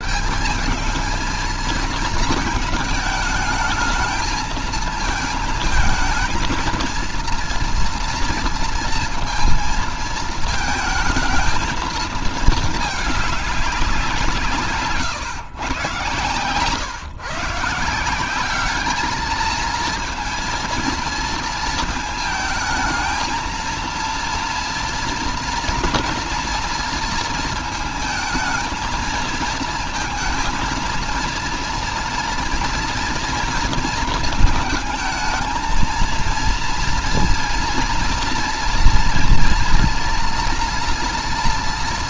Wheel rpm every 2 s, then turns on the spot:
200, 220, 230, 230, 230, 220, 220, 150, 130, 200, 230, 220, 230, 230, 220, 230, 240, 220, 230, 230, 240.
none